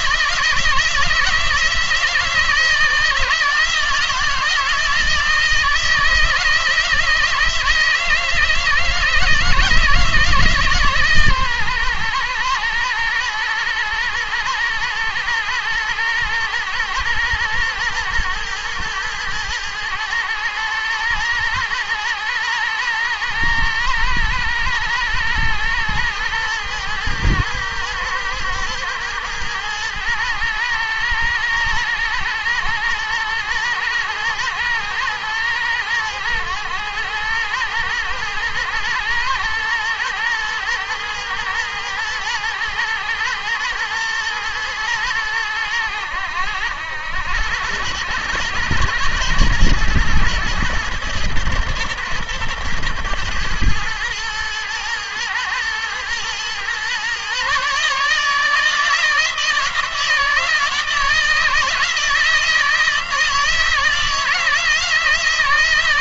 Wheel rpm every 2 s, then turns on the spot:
160, 160, 170, 160, 160, 150, 120, 120, 120, 110, 110, 120, 110, 120, 110, 110, 110, 120, 110, 110, 110, 120, 110, 100, 110, 110, 110, 110, 120, 160, 160, 160, 160.
none